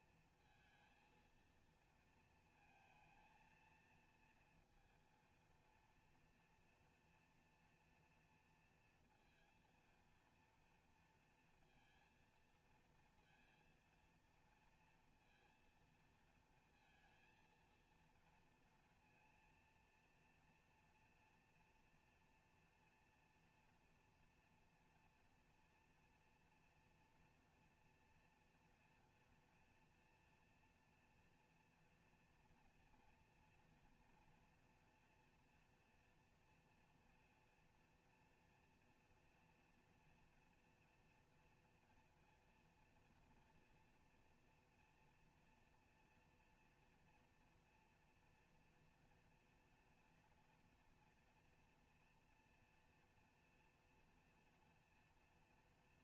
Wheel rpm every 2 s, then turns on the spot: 230, 220, 230, 230, 230, 230, 230, 230, 230, 230, 240, 230, 240, 240, 230, 240, 230, 230, 230, 230, 230, 230, 240, 230, 230, 230, 230, 230.
none